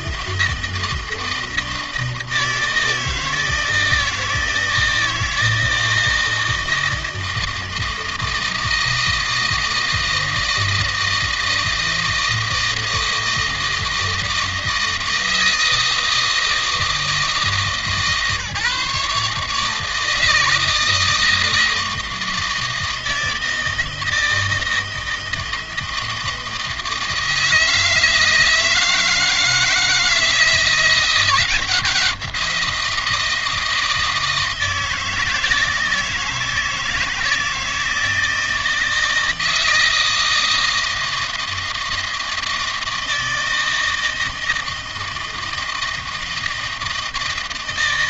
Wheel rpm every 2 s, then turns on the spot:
160, 160, 160, 160, 160, 160, 160, 160, 160, 150, 160, 160, 160, 160, 160, 170, 170, 160, 160, 160, 160, 160, 160, 160.
none